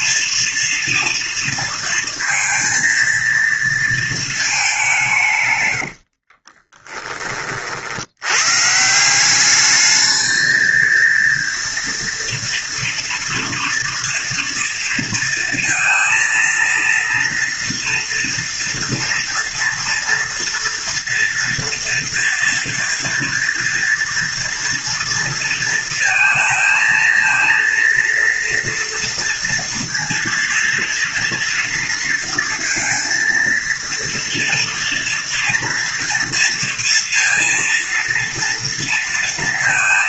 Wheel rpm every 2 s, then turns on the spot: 230, 230, 200, 30, 140, 220, 230, 230, 230, 230, 230, 240, 230, 230, 230, 230, 230, 230, 230, 230.
6-8